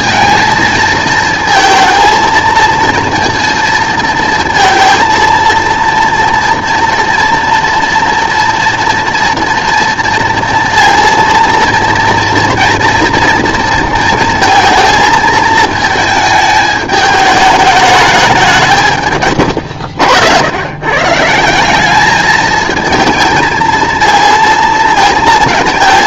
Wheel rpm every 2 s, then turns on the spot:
220, 230, 230, 230, 230, 230, 230, 230, 210, 160, 120, 220, 230.
none